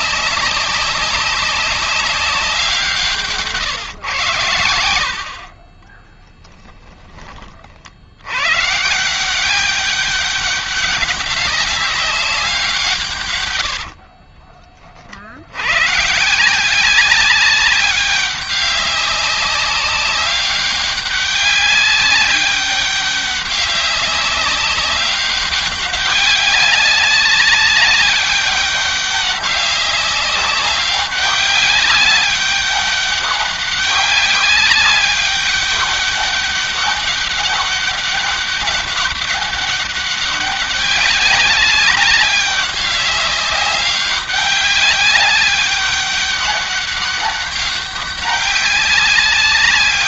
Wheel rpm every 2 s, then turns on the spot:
200, 170, 70, 20, 160, 200, 140, 50, 190, 200, 200, 200, 200, 190, 190, 200, 200, 200, 200, 200, 200, 200, 200, 200, 200.
4-6 12-14